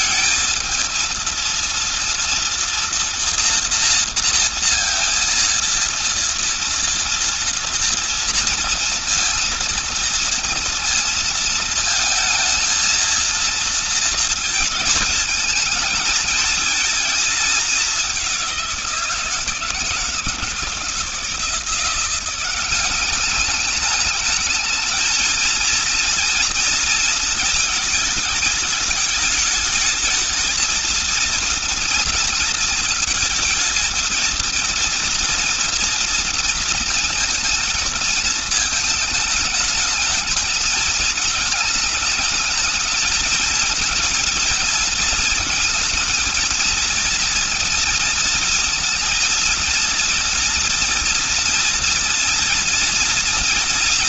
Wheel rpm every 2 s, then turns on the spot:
220, 230, 230, 230, 230, 230, 230, 220, 220, 180, 150, 190, 220, 230, 210, 230, 230, 230, 230, 220, 220, 220, 230, 230, 230, 230, 230.
none